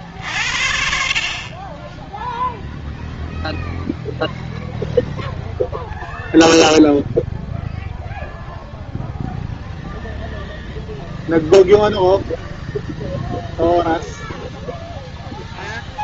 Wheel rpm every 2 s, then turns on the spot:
50, 10, 0, 0, 0, 0, 0, 0.
none